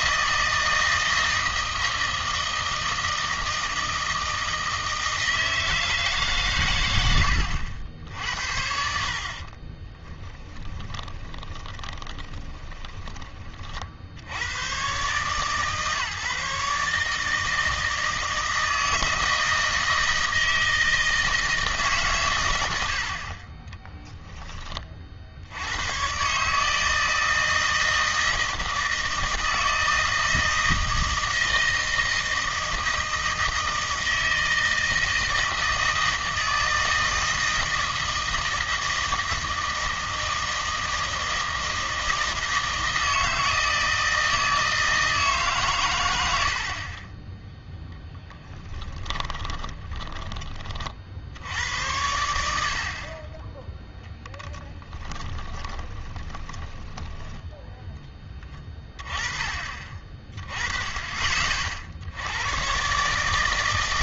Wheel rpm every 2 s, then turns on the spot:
160, 160, 160, 120, 60, 10, 10, 110, 150, 160, 160, 90, 20, 150, 160, 160, 160, 160, 160, 160, 160, 160, 160, 70, 10, 30, 60, 10, 20, 20, 30, 120.
10-14 48-50 54-58